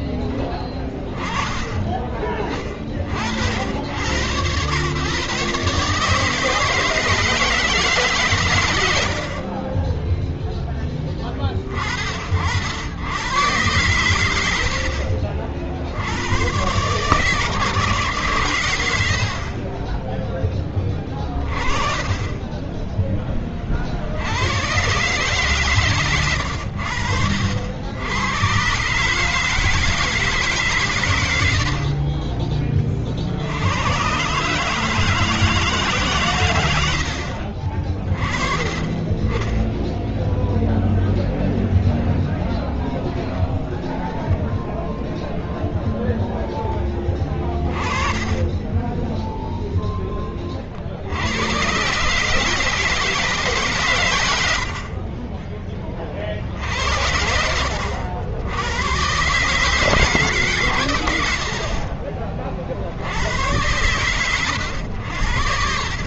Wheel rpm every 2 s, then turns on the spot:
10, 30, 110, 160, 110, 10, 70, 60, 120, 130, 20, 10, 120, 90, 120, 140, 30, 150, 100, 20, 0, 0, 0, 10, 10, 40, 150, 70, 70, 100, 120, 60, 110.
48-50 54-56